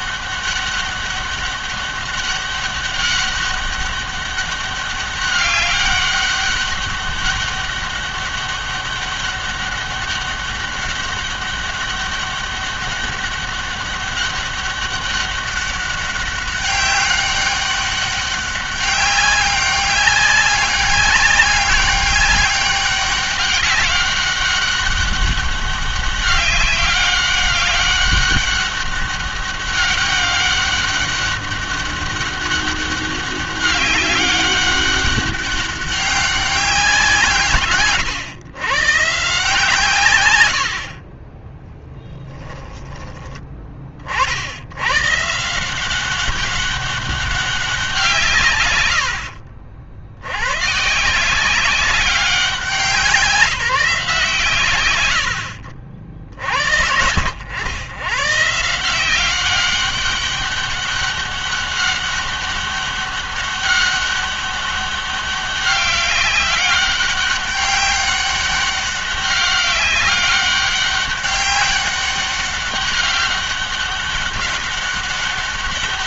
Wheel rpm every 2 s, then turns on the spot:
200, 200, 200, 200, 200, 200, 200, 200, 200, 200, 200, 200, 200, 200, 200, 200, 200, 200, 180, 120, 80, 10, 100, 200, 110, 120, 180, 110, 80, 160, 200, 200, 200, 200, 200, 200, 200, 200.
40-44 48-50